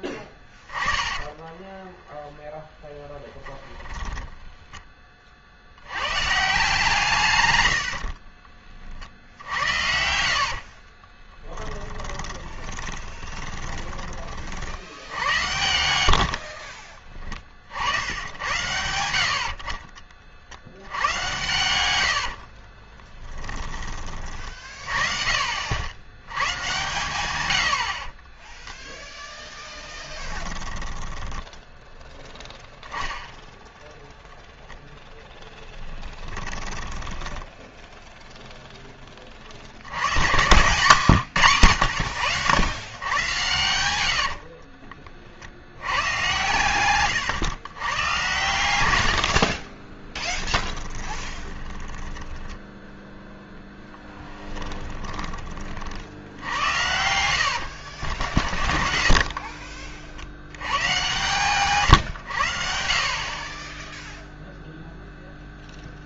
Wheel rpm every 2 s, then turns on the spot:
10, 20, 10, 150, 40, 60, 20, 50, 60, 90, 60, 40, 30, 110, 10, 10, 0, 0, 20, 0, 130, 100, 50, 120, 110, 10, 10, 10, 80, 30, 90, 70, 0.
0-4 10-14 16-18 22-24 28-32 36-38 40-42 44-48 50-56 58-60